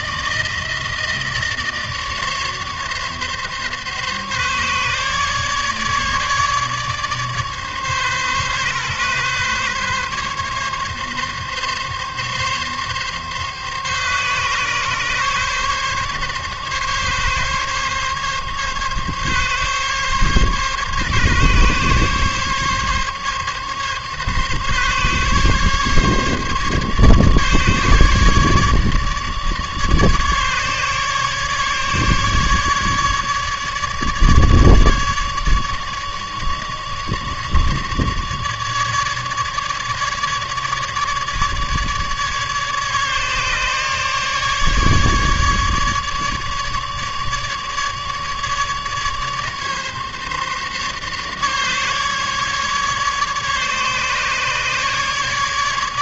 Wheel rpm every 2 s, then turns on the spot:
160, 150, 140, 140, 140, 140, 140, 140, 140, 140, 140, 140, 140, 140, 150, 150, 150, 150, 150, 150, 150, 150, 150, 150, 150, 140, 150, 150.
none